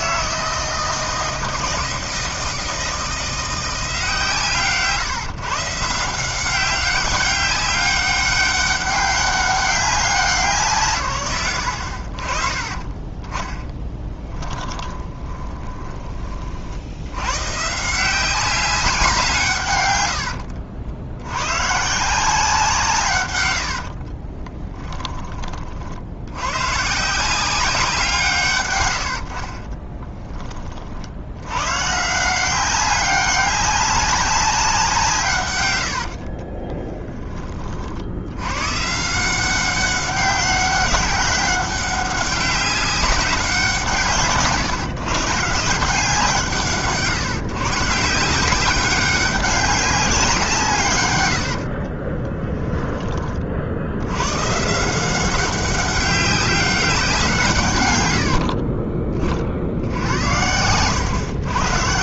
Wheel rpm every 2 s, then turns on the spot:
160, 160, 150, 190, 200, 150, 30, 20, 70, 190, 70, 160, 10, 120, 120, 40, 190, 180, 30, 130, 190, 190, 140, 150, 190, 140, 10, 140, 190, 40, 90.
14-16 24-26 36-38 58-62